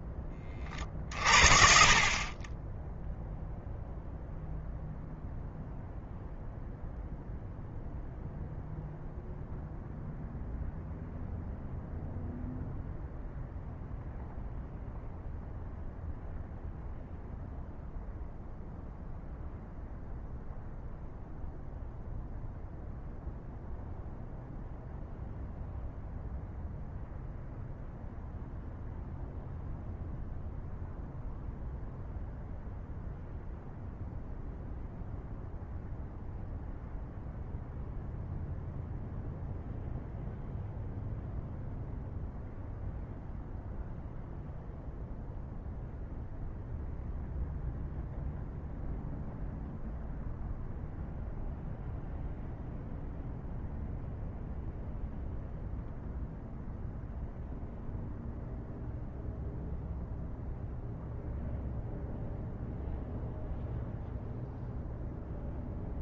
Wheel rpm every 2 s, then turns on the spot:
30, 30, 0, 0, 0, 0, 0, 0, 0, 0, 0, 0, 0, 0, 0, 0, 0, 0, 0, 0, 0, 0, 0, 0, 0, 0, 0, 0, 0, 0, 0, 0, 0.
none